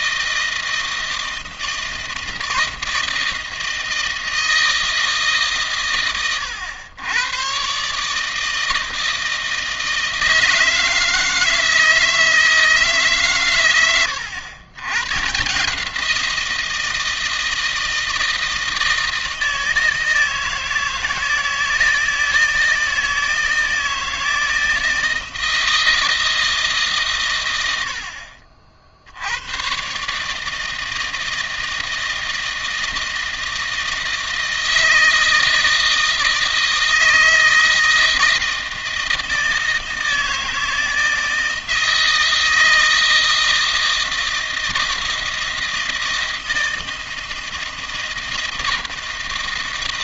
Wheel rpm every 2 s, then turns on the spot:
160, 160, 160, 110, 160, 160, 140, 110, 170, 160, 160, 160, 160, 130, 70, 160, 160, 160, 160, 160, 160, 160, 160, 160, 160.
none